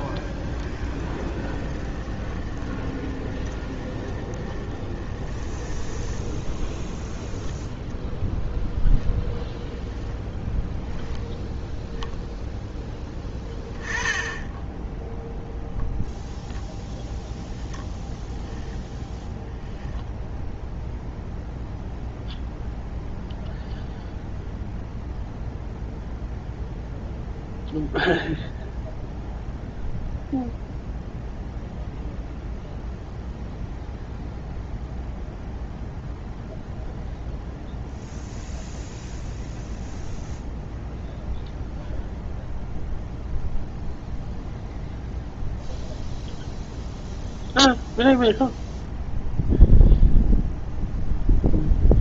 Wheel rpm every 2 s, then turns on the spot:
10, 20, 20, 0, 0, 0, 0, 10, 0, 0, 0, 0, 0, 0, 0, 0, 0, 0, 0, 0, 0, 0, 0, 0, 0, 0.
0-6